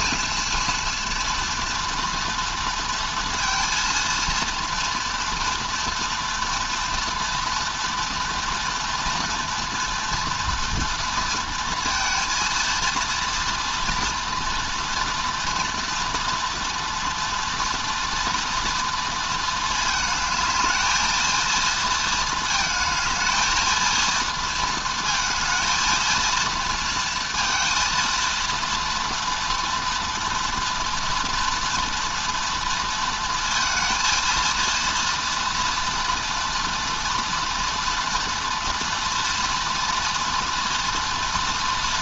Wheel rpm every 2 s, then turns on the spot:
230, 230, 230, 230, 240, 230, 230, 230, 240, 230, 210, 220, 230, 230, 230, 230, 230, 230, 230, 230, 230.
none